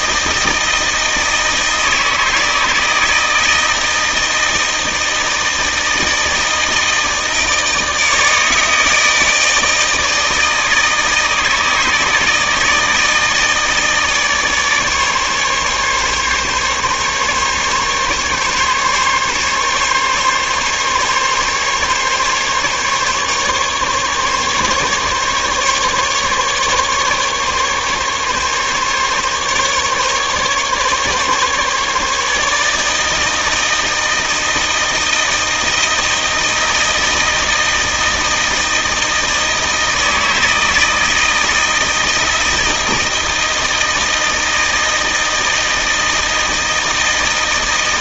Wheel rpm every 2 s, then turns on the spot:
160, 160, 160, 160, 160, 160, 160, 150, 140, 150, 140, 140, 140, 140, 140, 140, 160, 160, 160, 160, 160, 160, 160, 160.
none